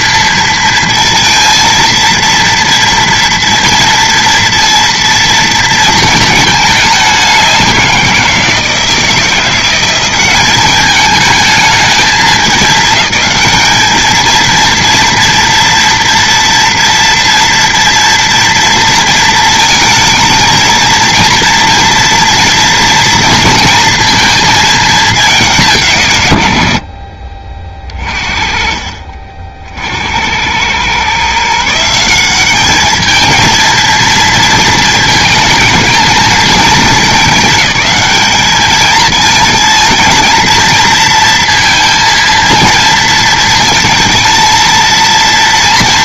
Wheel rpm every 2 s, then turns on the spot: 230, 230, 230, 210, 170, 200, 210, 230, 230, 230, 230, 230, 220, 80, 30, 90, 200, 230, 220, 210, 230, 230, 230.
26-28